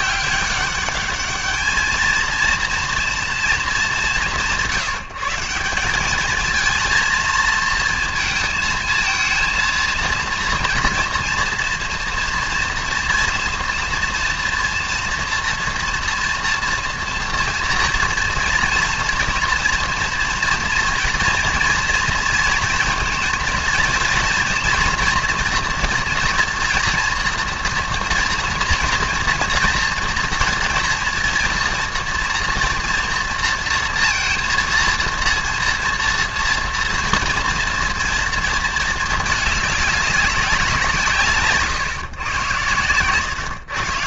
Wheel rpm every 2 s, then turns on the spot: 200, 230, 170, 220, 230, 230, 240, 230, 230, 230, 230, 230, 240, 230, 230, 230, 230, 230, 230, 220, 190, 120.
none